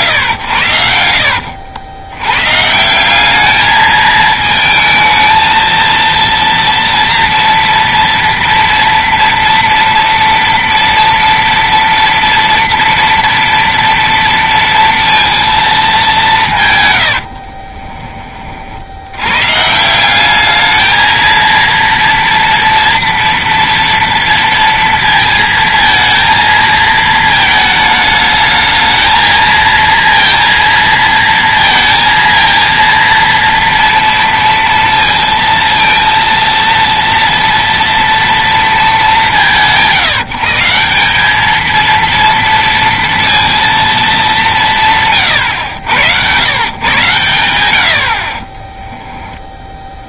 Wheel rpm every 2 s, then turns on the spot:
100, 140, 220, 230, 230, 230, 230, 230, 140, 40, 220, 230, 230, 230, 220, 230, 230, 230, 230, 220, 160, 230, 190, 110, 20.
48-50